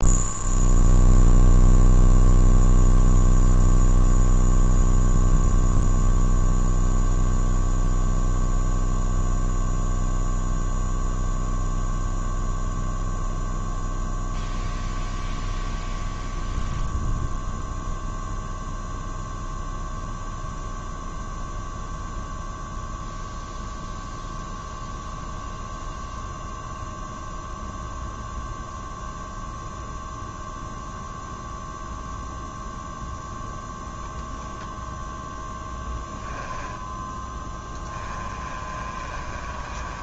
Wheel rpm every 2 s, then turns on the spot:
0, 0, 0, 0, 0, 0, 0, 0, 0, 0, 0, 0, 0, 0, 0, 0, 0, 0, 10, 30.
36-40